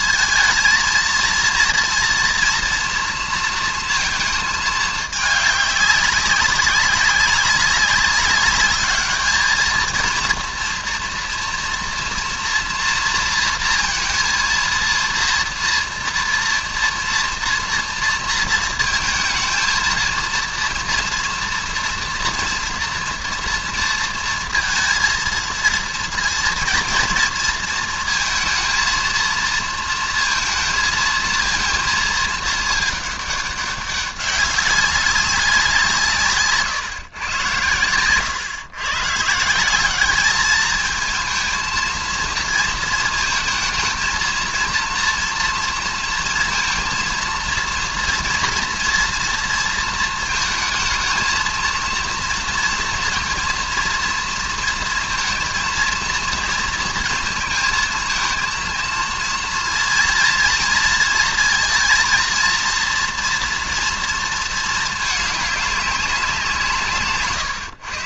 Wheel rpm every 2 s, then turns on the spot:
230, 230, 210, 200, 210, 230, 230, 230, 230, 230, 230, 240, 230, 230, 230, 230, 210, 190, 140, 120, 220, 230, 230, 230, 240, 220, 230, 230, 230, 230, 230, 230, 220, 160.
none